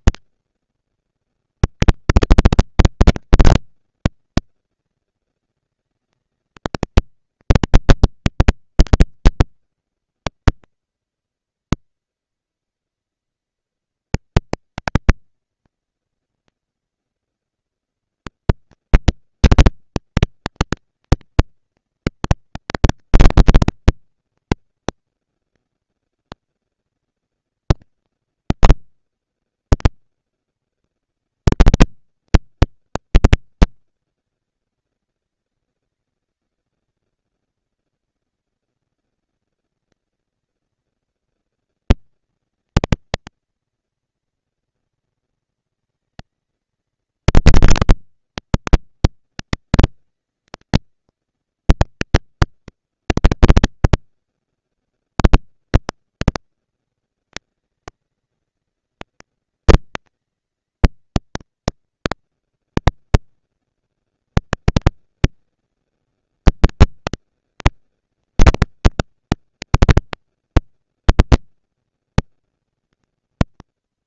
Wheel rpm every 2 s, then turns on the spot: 230, 230, 230, 220, 230, 230, 230, 220, 230, 230, 220, 230, 240, 230, 240, 230, 220, 190, 200, 220, 230, 230, 230, 230, 230, 230, 230, 230, 230, 220, 230, 230, 220, 210, 200, 220, 230.
none